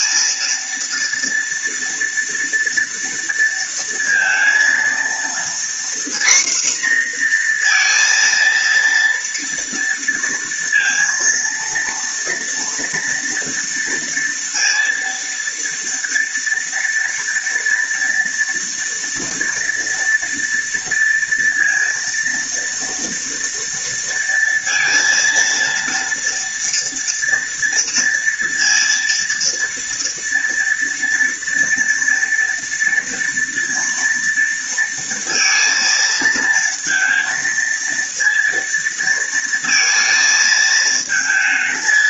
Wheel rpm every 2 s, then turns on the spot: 230, 230, 230, 240, 230, 230, 230, 230, 230, 230, 230, 230, 230, 230, 230, 230, 230, 230, 230, 230, 220.
none